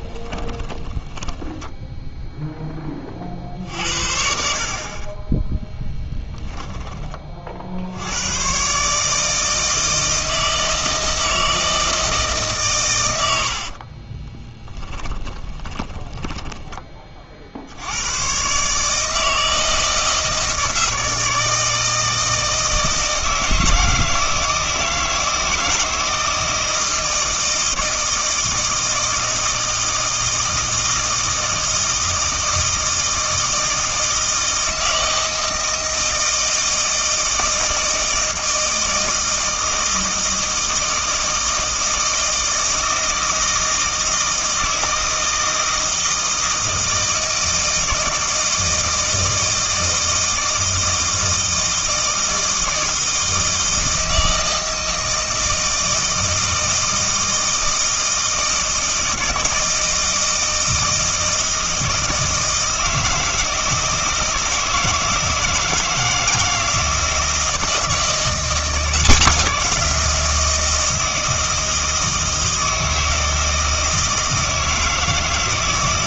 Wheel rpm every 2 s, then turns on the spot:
20, 10, 50, 10, 140, 160, 130, 20, 20, 140, 160, 160, 160, 160, 160, 160, 160, 160, 160, 160, 160, 160, 160, 160, 160, 160, 160, 160, 160, 160, 160, 160, 160, 170, 180, 160, 160, 160.
0-2 14-16